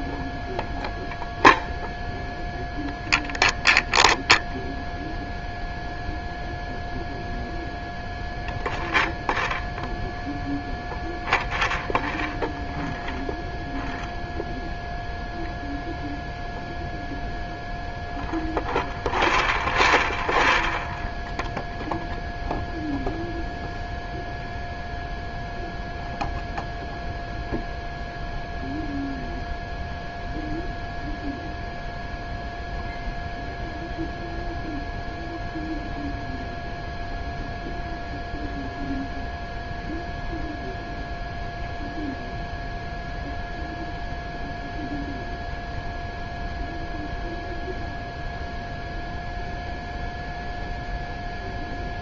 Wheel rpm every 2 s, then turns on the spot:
0, 0, 0, 0, 0, 0, 0, 0, 0, 0, 0, 0, 0, 0, 0, 0, 0, 0, 0, 0, 0, 0, 0, 0, 0, 0.
none